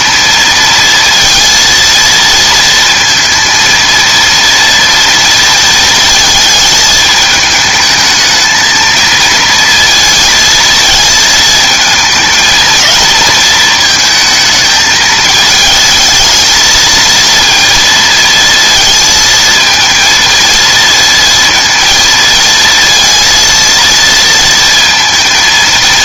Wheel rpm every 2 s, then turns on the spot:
230, 230, 230, 220, 220, 230, 220, 220, 220, 230, 230, 230, 230.
none